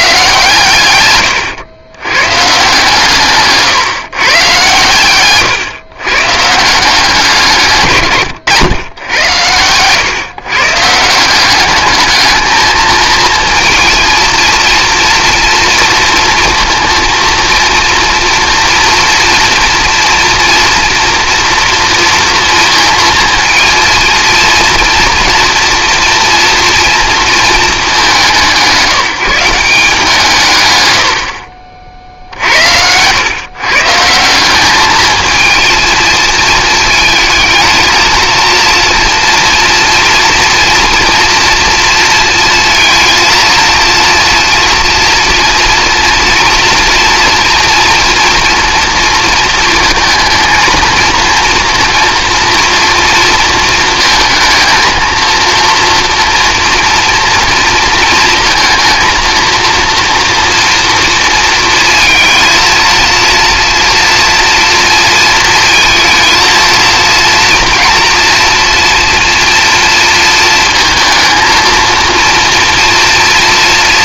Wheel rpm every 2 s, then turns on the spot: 130, 140, 120, 180, 110, 150, 220, 230, 230, 230, 230, 230, 230, 230, 180, 100, 80, 210, 220, 230, 230, 230, 230, 230, 230, 230, 230, 230, 240, 230, 230, 230, 230, 230, 240, 230, 230.
none